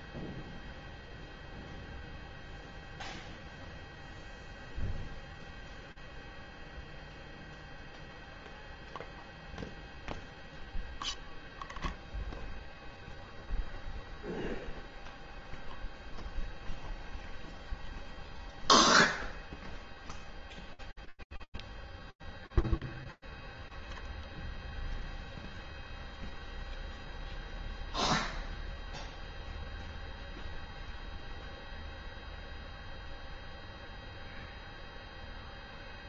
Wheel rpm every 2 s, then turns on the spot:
0, 0, 0, 0, 0, 0, 0, 0, 0, 0, 0, 0, 0, 0, 0, 0, 0, 0.
none